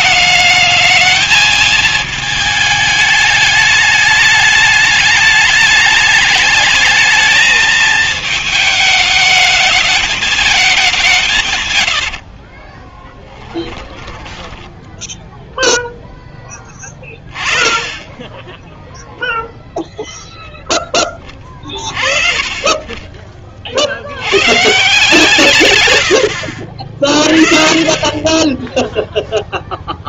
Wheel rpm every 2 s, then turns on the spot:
220, 210, 210, 220, 220, 200, 30, 10, 10, 0, 10, 30, 150, 50, 10.
12-14 16-18